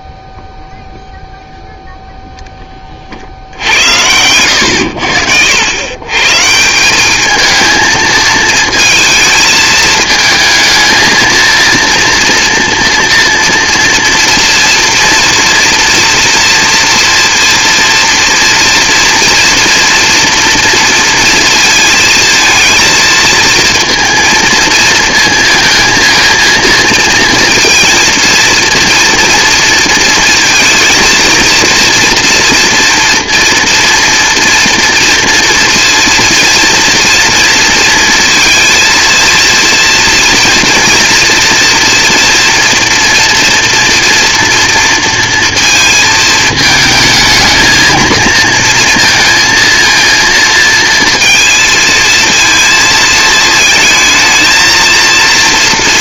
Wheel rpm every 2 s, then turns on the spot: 0, 20, 90, 170, 220, 220, 230, 240, 240, 230, 230, 230, 230, 230, 230, 230, 230, 230, 230, 230, 230, 240, 230, 220, 230, 230, 230, 230.
none